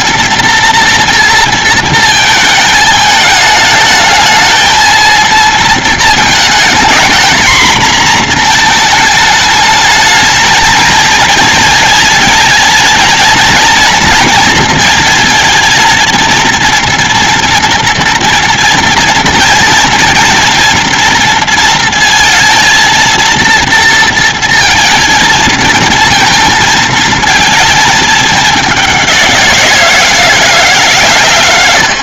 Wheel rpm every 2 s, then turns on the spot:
230, 220, 220, 230, 240, 220, 230, 230, 230, 240, 230, 230, 230, 230, 220, 170.
none